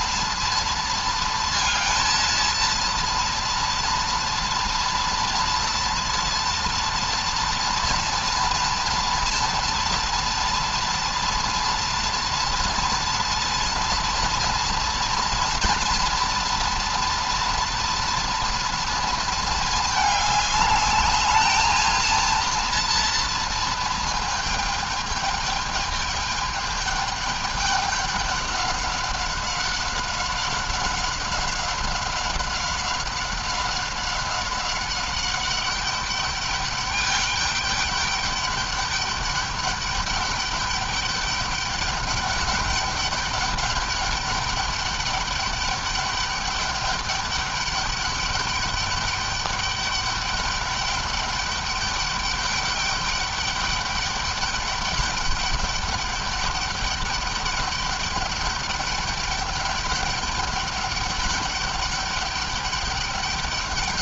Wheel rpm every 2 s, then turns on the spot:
230, 230, 230, 230, 230, 230, 230, 230, 240, 230, 210, 230, 220, 210, 200, 190, 190, 190, 200, 210, 200, 200, 200, 200, 200, 200, 200, 200, 200, 200, 210, 200.
none